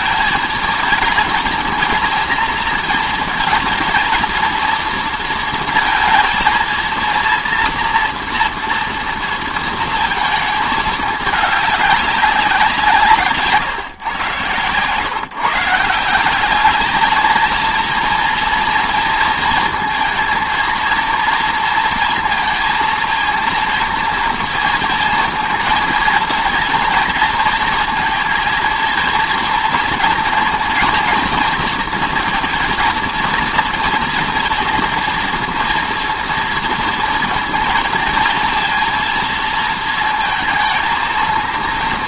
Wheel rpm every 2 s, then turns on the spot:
230, 230, 230, 230, 230, 220, 180, 120, 210, 230, 230, 230, 230, 230, 230, 230, 230, 230, 230, 230, 230.
none